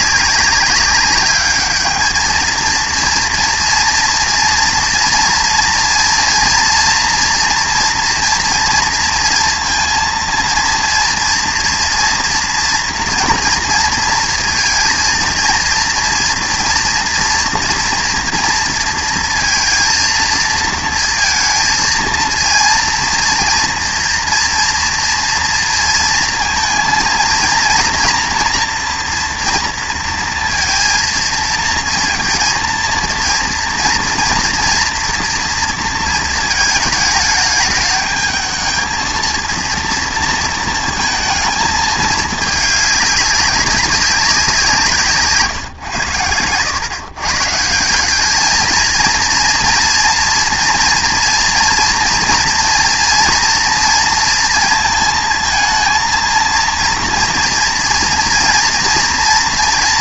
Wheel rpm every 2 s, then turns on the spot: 200, 230, 230, 240, 230, 230, 230, 230, 240, 230, 230, 230, 230, 230, 230, 230, 230, 230, 220, 220, 230, 210, 180, 110, 230, 230, 230, 230, 230, 230.
none